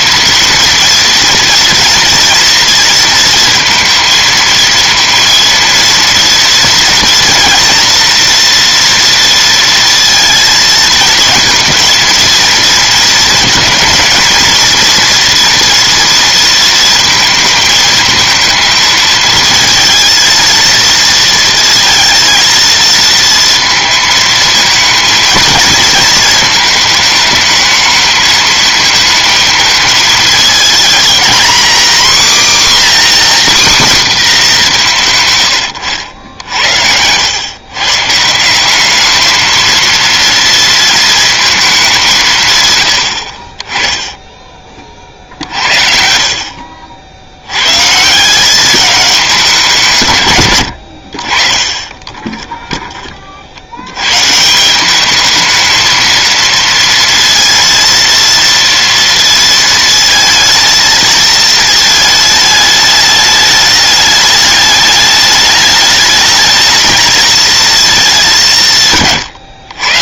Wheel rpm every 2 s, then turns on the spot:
230, 230, 230, 230, 240, 230, 230, 230, 230, 220, 230, 230, 230, 220, 220, 230, 270, 180, 90, 200, 230, 110, 40, 50, 200, 90, 20, 180, 230, 230, 220, 210, 210, 220, 140.
none